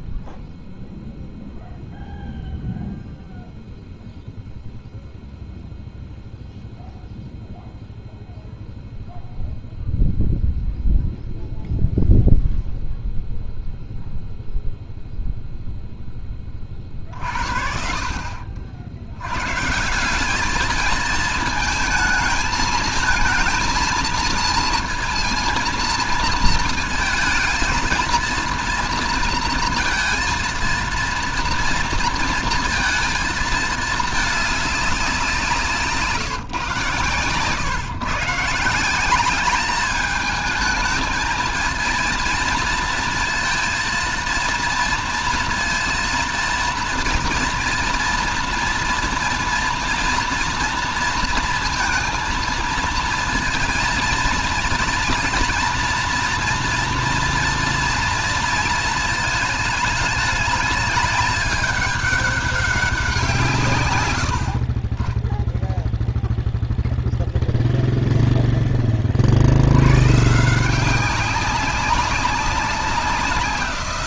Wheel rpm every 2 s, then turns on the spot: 0, 0, 0, 0, 0, 0, 0, 40, 60, 210, 220, 230, 230, 230, 230, 230, 200, 120, 160, 220, 230, 230, 230, 230, 240, 230, 230, 240, 230, 210, 200, 80, 0, 0, 100, 190, 180.
none